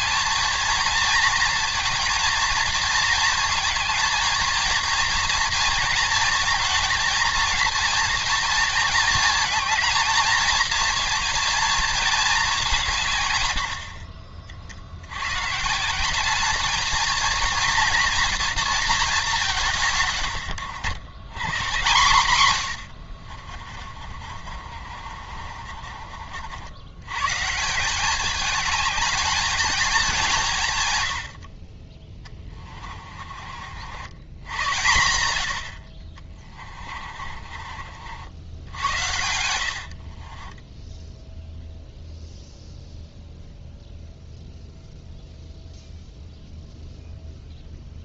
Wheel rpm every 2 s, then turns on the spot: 230, 220, 230, 230, 230, 230, 170, 70, 220, 220, 90, 80, 50, 90, 210, 100, 30, 100, 30, 80, 10, 0, 0, 0.
22-26 32-34 36-42